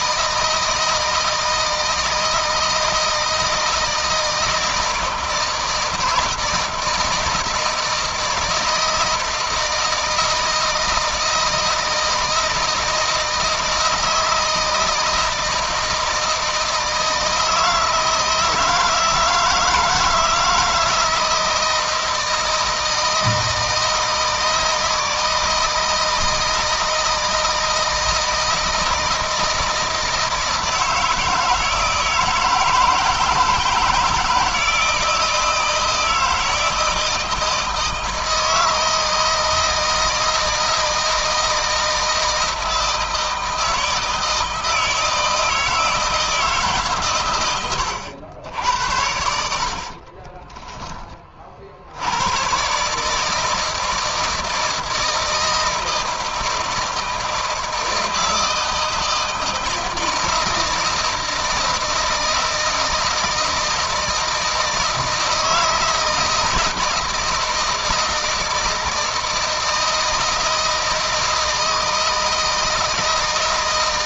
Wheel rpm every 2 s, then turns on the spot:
160, 160, 160, 160, 160, 160, 160, 160, 160, 160, 160, 160, 160, 160, 160, 160, 160, 160, 160, 160, 160, 160, 160, 140, 90, 20, 130, 160, 160, 160, 160, 160, 160, 170, 160, 160, 160.
none